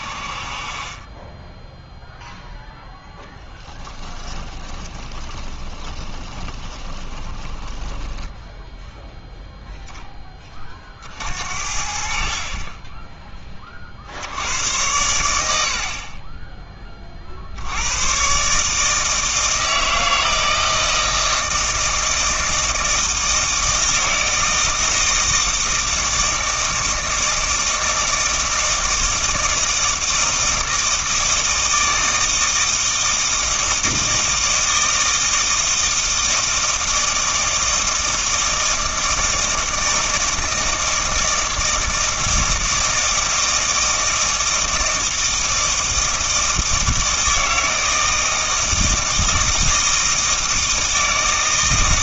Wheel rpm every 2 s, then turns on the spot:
30, 0, 20, 20, 0, 40, 20, 100, 20, 150, 160, 160, 160, 160, 160, 160, 160, 160, 160, 160, 160, 160, 160, 160, 160, 160.
4-8